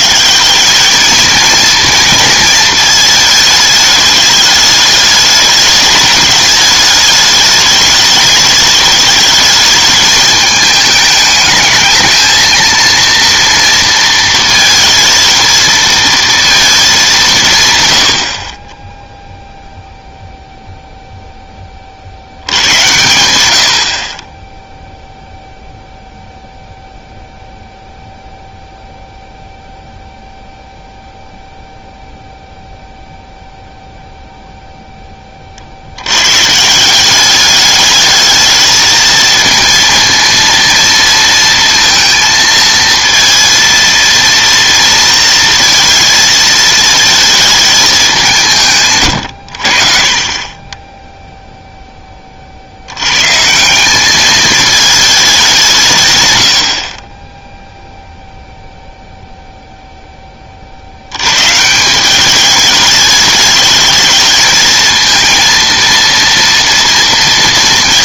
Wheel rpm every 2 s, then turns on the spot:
200, 220, 210, 210, 210, 210, 230, 230, 220, 20, 0, 100, 0, 0, 0, 0, 0, 0, 170, 220, 230, 230, 230, 220, 150, 20, 60, 220, 70, 0, 60, 210, 220, 230.
none